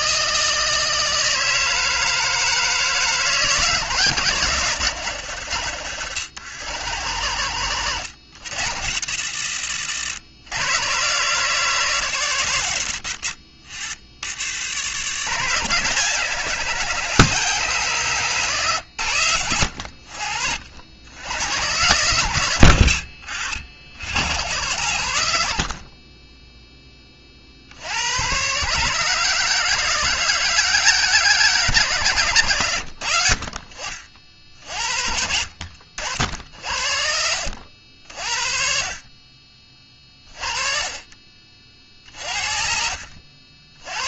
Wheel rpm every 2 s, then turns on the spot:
160, 160, 130, 110, 80, 130, 80, 90, 140, 110, 80, 70, 90, 20, 150, 160, 80, 60, 60, 40, 30, 60.
42-44